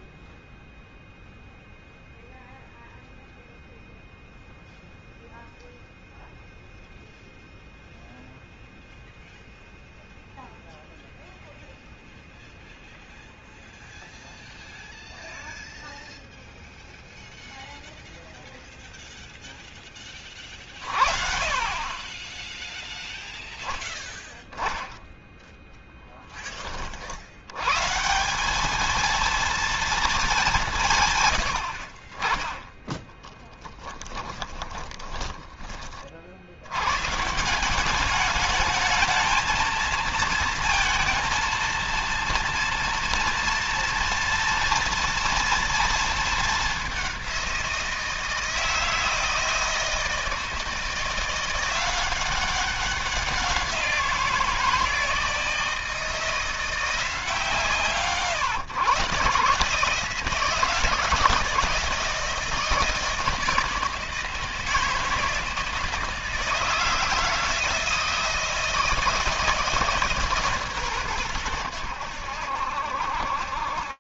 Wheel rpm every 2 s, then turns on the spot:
0, 0, 0, 0, 0, 0, 0, 0, 0, 0, 50, 0, 0, 50, 220, 150, 20, 30, 120, 220, 230, 240, 230, 200, 160, 160, 190, 170, 170, 140, 160, 160, 160, 160, 170, 120, 70.
32-36